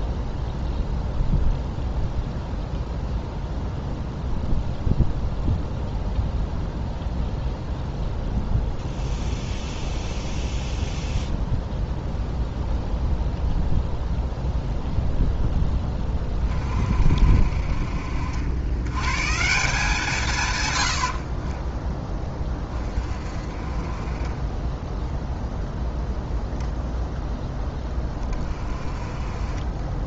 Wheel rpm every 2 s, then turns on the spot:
0, 0, 0, 0, 0, 0, 0, 0, 40, 100, 90, 30, 10, 0, 20.
none